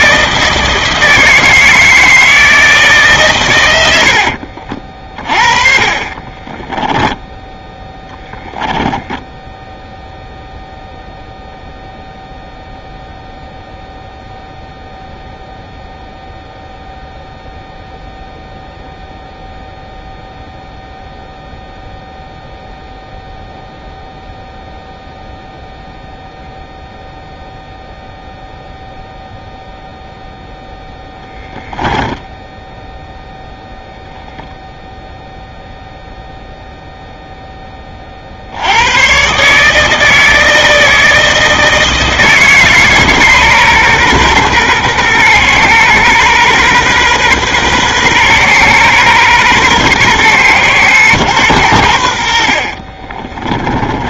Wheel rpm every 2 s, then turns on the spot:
160, 160, 40, 10, 10, 0, 0, 0, 0, 0, 0, 0, 0, 0, 0, 0, 0, 0, 0, 90, 160, 150, 130, 130, 130, 120, 40.
4-8 52-54